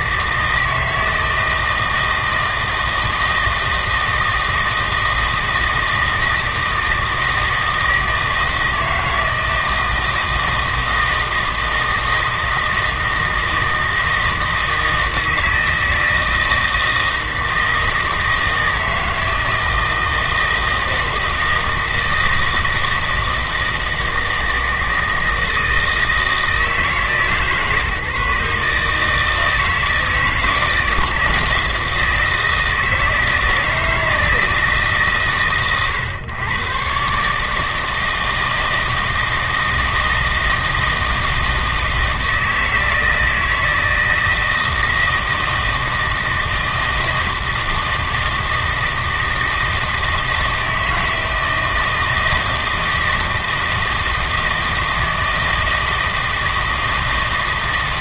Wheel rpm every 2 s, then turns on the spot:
160, 160, 160, 160, 160, 160, 160, 160, 160, 160, 160, 160, 160, 160, 150, 160, 160, 160, 130, 160, 160, 160, 160, 160, 160, 160, 160, 160, 160.
none